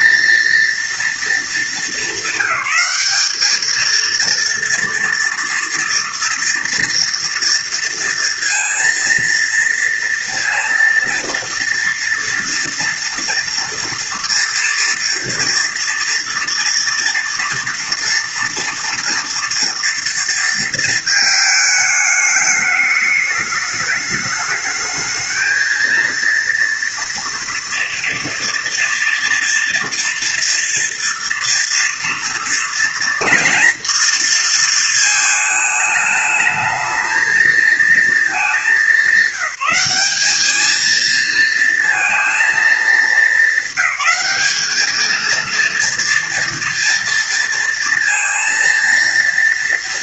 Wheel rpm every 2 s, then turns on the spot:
230, 200, 230, 230, 230, 230, 230, 230, 230, 230, 220, 210, 210, 230, 230, 230, 230, 220, 220, 200, 220, 220, 210, 230, 230.
none